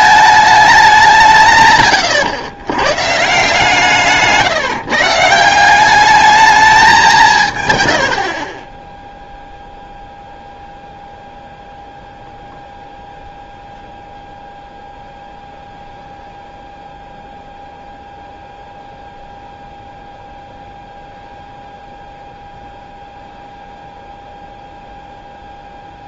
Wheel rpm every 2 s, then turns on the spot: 210, 120, 170, 210, 40, 0, 0, 0, 0, 0, 0, 0, 0.
none